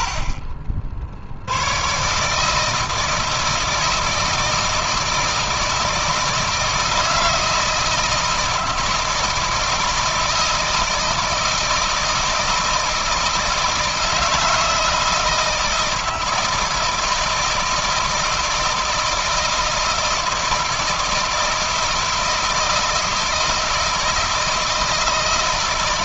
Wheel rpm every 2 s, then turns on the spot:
50, 160, 160, 160, 160, 160, 160, 160, 160, 160, 160, 160, 160.
none